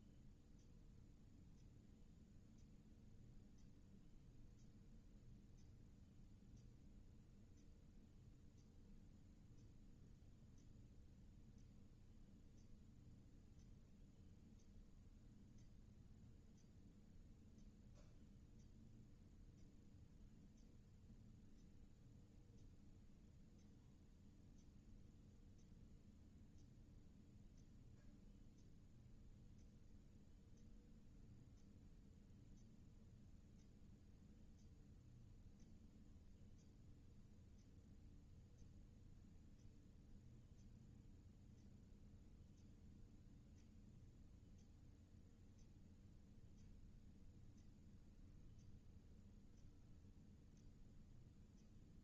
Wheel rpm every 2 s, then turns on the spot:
0, 0, 0, 0, 0, 0, 0, 0, 0, 0, 0, 0, 0, 0, 0, 0, 0, 0, 0, 0, 0, 0, 0, 0, 0, 0.
none